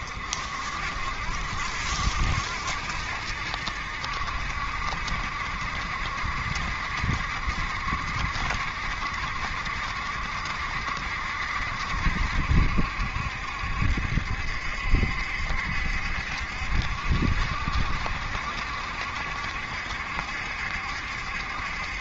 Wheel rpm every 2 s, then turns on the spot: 60, 70, 70, 70, 70, 70, 70, 70, 70, 70, 70.
none